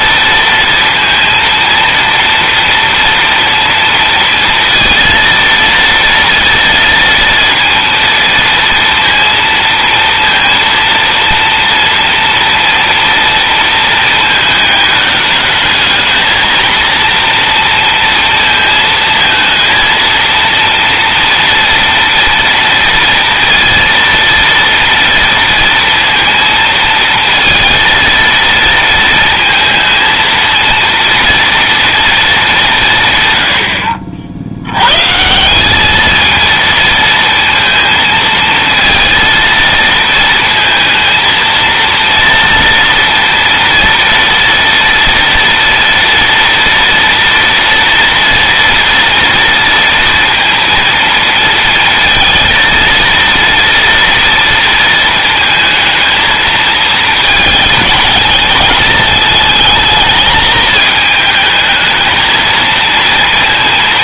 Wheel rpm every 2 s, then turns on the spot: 230, 230, 230, 230, 230, 230, 230, 220, 230, 220, 230, 230, 230, 230, 230, 230, 170, 110, 230, 230, 230, 230, 230, 230, 230, 230, 230, 230, 220, 220, 220, 230.
none